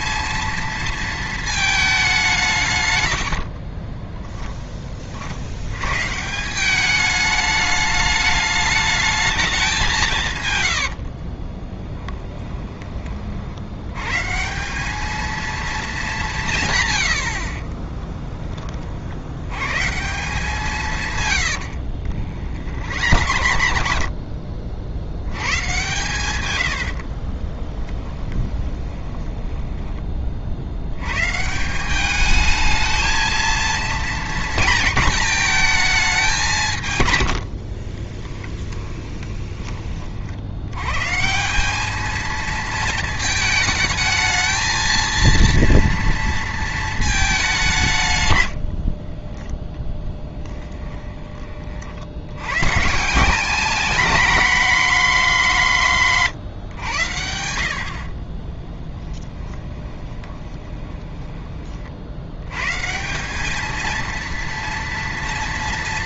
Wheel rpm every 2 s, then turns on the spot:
230, 150, 30, 190, 210, 90, 20, 200, 130, 40, 160, 60, 50, 100, 20, 70, 220, 230, 150, 10, 100, 230, 220, 220, 70, 20, 140, 230, 130, 10, 20, 140, 230.
10-12 22-24 28-30 38-40 48-52 58-62